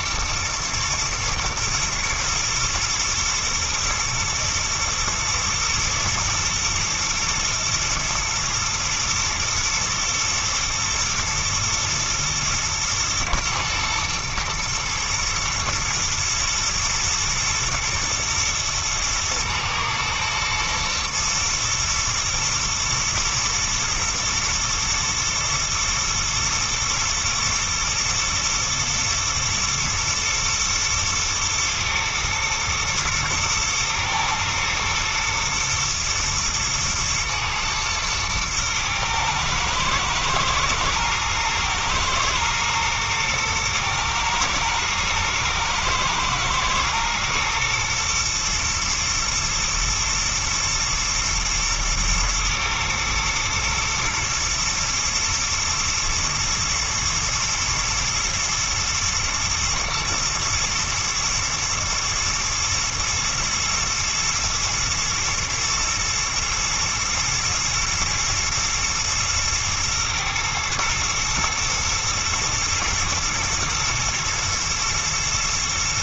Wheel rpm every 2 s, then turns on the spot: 120, 110, 110, 110, 110, 110, 110, 120, 120, 120, 120, 110, 120, 120, 110, 110, 110, 110, 120, 110, 110, 110, 120, 110, 120, 120, 110, 120, 110, 120, 120, 110, 110, 120, 120, 120, 120, 120.
none